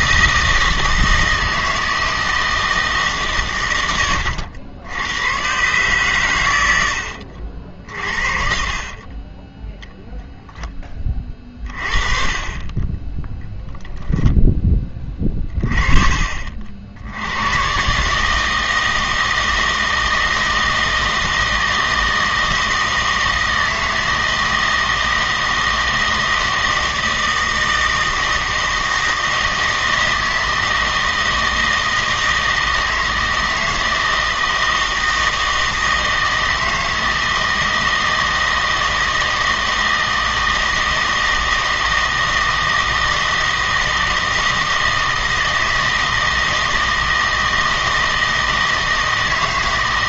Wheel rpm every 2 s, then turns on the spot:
160, 160, 80, 90, 40, 20, 30, 10, 60, 160, 160, 160, 160, 160, 160, 160, 160, 160, 160, 160, 160, 160, 160, 160, 160.
8-10